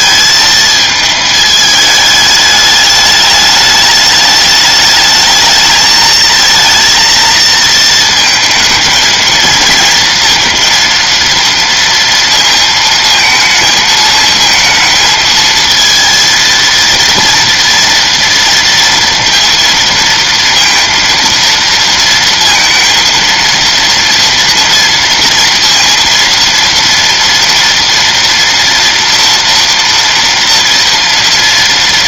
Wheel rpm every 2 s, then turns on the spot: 220, 210, 210, 230, 220, 230, 220, 220, 230, 230, 230, 230, 230, 230, 240, 230.
none